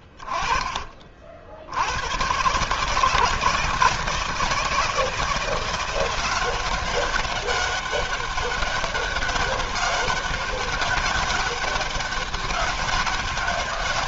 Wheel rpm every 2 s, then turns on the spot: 80, 160, 170, 200, 200, 200, 190.
none